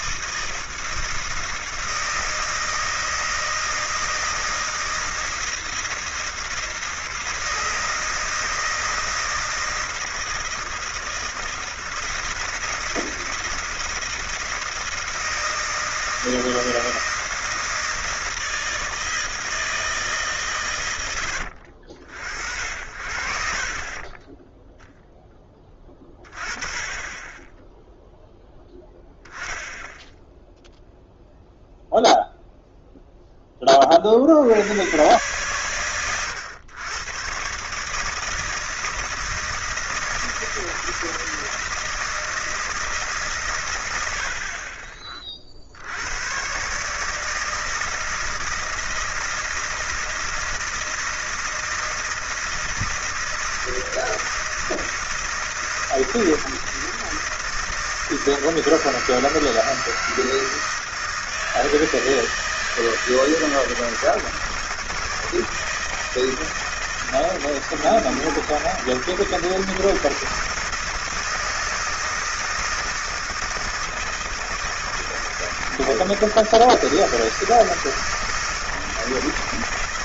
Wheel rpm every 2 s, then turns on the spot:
160, 160, 160, 160, 160, 160, 160, 160, 160, 160, 120, 60, 0, 20, 10, 0, 0, 100, 110, 160, 160, 160, 40, 140, 160, 160, 160, 160, 160, 160, 160, 160, 160, 160, 160, 160, 170, 160, 160, 160.
none